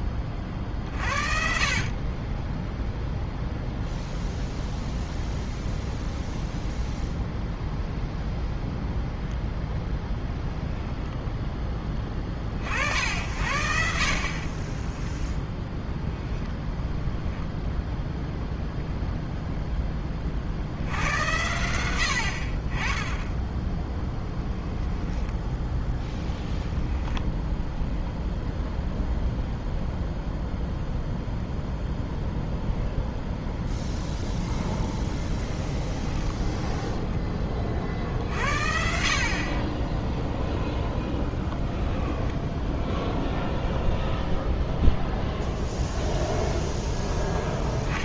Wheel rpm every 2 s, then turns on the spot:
40, 10, 0, 0, 0, 0, 50, 30, 0, 0, 60, 40, 10, 10, 0, 0, 0, 0, 10, 60, 0, 0, 0, 0.
14-16 24-26 36-38